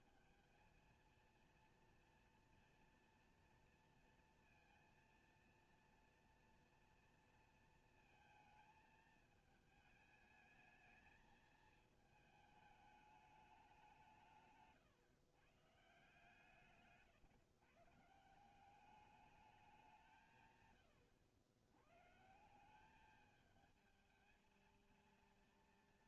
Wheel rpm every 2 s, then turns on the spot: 230, 230, 240, 220, 210, 220, 180, 150, 150, 190, 130, 220, 190.
none